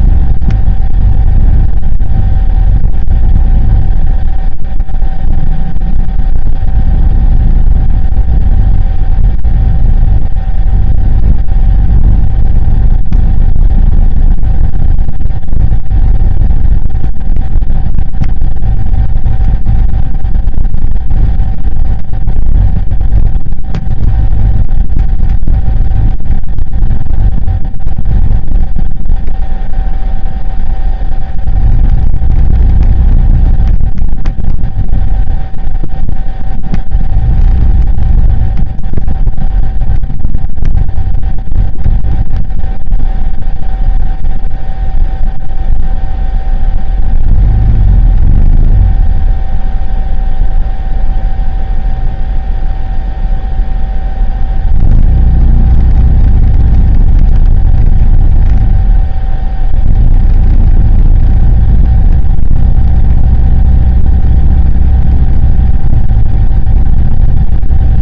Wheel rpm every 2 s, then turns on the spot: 0, 0, 0, 0, 0, 0, 0, 0, 0, 0, 0, 0, 0, 0, 0, 0, 0, 0, 0, 0, 0, 0, 0, 0, 0, 0, 0, 0, 0, 0, 0, 0, 0, 0.
none